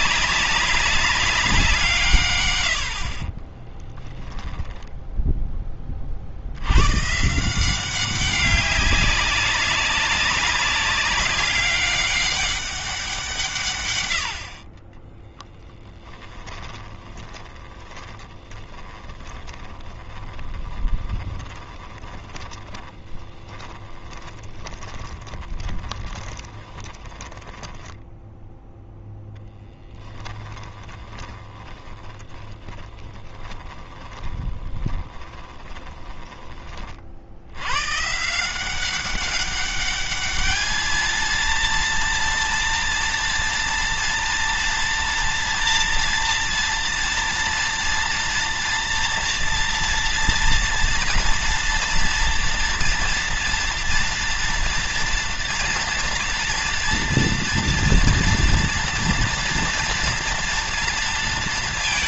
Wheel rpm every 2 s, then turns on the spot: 200, 70, 0, 120, 190, 190, 190, 40, 20, 20, 20, 10, 20, 10, 0, 10, 20, 20, 30, 180, 220, 230, 230, 230, 240, 230, 230, 230, 230, 230, 230.
14-28 30-36